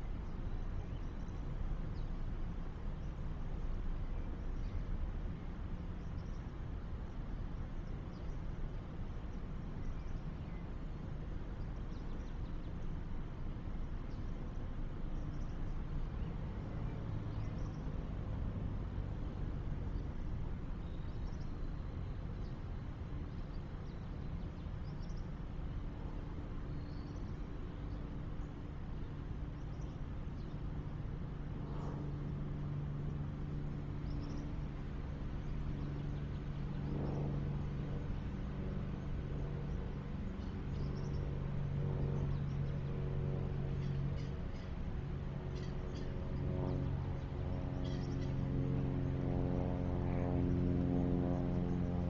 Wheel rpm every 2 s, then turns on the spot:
0, 0, 0, 0, 0, 0, 0, 0, 0, 0, 0, 0, 0, 0, 0, 0, 0, 0, 0, 0, 0, 0, 0, 0, 0, 0.
none